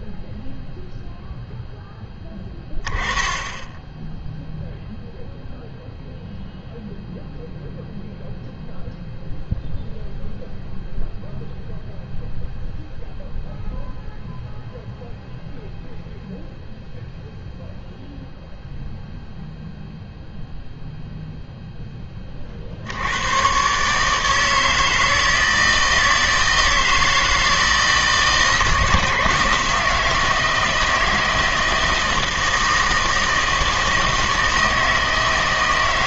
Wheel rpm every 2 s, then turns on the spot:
0, 20, 0, 0, 0, 0, 0, 0, 0, 0, 0, 60, 160, 160, 160, 160, 160, 160.
none